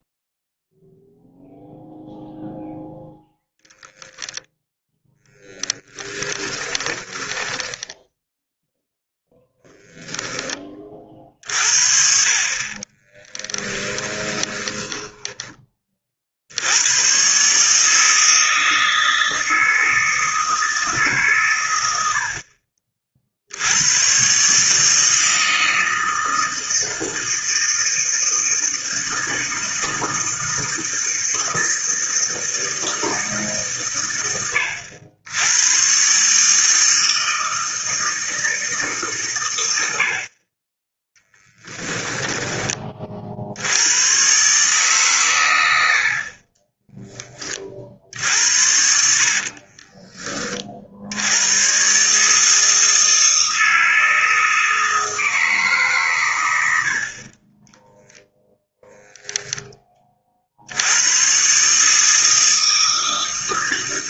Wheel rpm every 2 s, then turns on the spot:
0, 0, 10, 20, 0, 30, 30, 10, 100, 160, 150, 40, 150, 160, 160, 160, 160, 80, 160, 150, 20, 30, 140, 20, 60, 60, 160, 160, 60, 0, 90, 160.
4-8 12-16 46-48